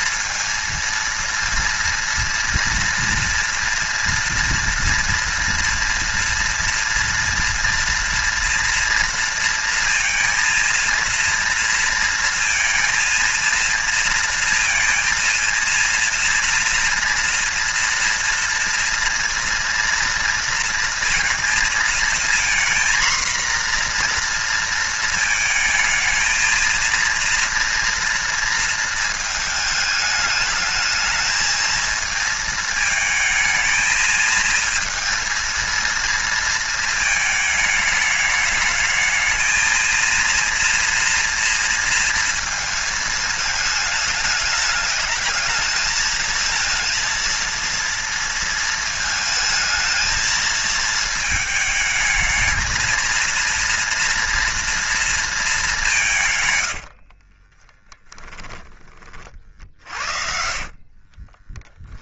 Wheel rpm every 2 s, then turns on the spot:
230, 230, 230, 230, 230, 230, 230, 230, 230, 230, 230, 240, 230, 230, 230, 210, 220, 230, 220, 210, 230, 220, 210, 220, 230, 220, 220, 230, 110, 10, 40.
56-58 60-62